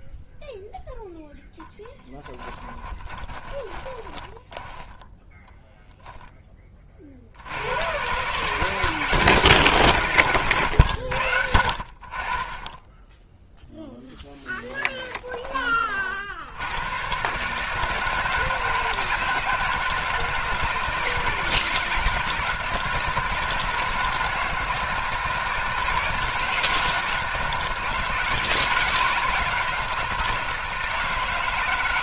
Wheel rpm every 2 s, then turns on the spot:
0, 20, 10, 30, 160, 100, 10, 10, 110, 160, 160, 160, 160, 160, 160, 160.
2-6